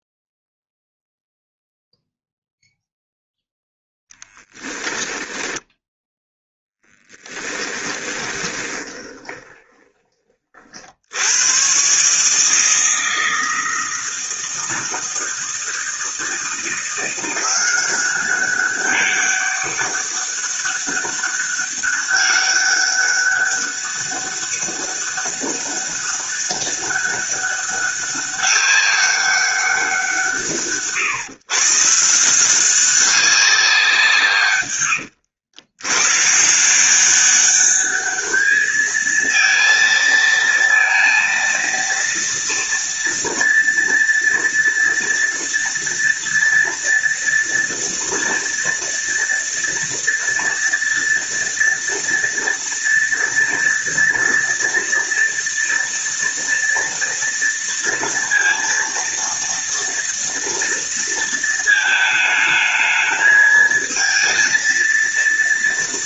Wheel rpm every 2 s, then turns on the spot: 0, 0, 10, 10, 20, 80, 160, 160, 170, 200, 200, 200, 200, 200, 200, 130, 190, 110, 190, 220, 230, 230, 230, 230, 230, 230, 230, 230, 230, 230, 230, 220, 230.
4-10 34-36